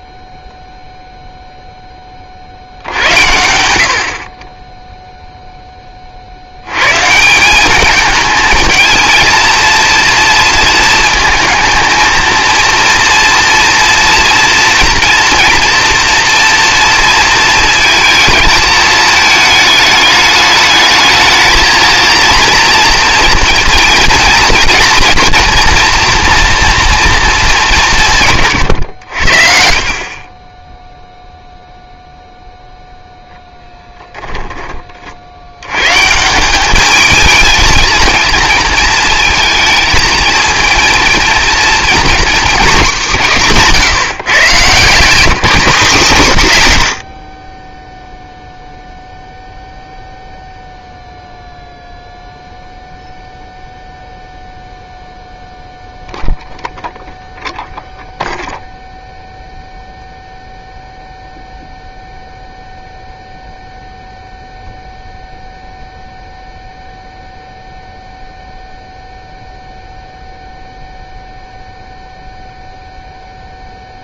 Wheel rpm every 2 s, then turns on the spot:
0, 90, 10, 140, 220, 230, 230, 230, 230, 220, 220, 230, 230, 230, 90, 0, 10, 90, 220, 220, 230, 160, 190, 30, 0, 0, 0, 0, 0, 0, 0, 0, 0, 0, 0, 0, 0.
32-34